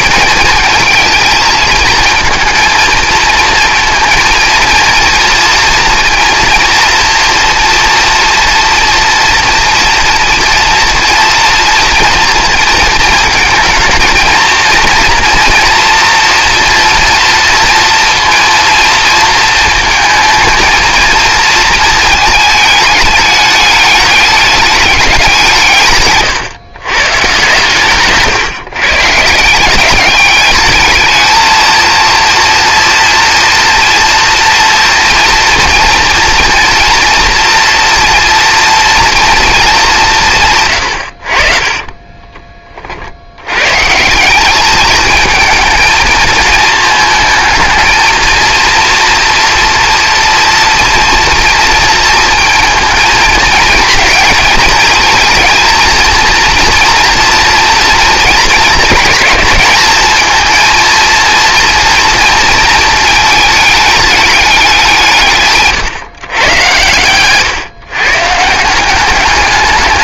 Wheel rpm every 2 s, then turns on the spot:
220, 230, 230, 230, 230, 230, 230, 230, 240, 230, 220, 210, 210, 130, 140, 210, 230, 230, 230, 240, 150, 30, 190, 220, 230, 230, 230, 230, 230, 220, 230, 230, 200, 130, 150.
none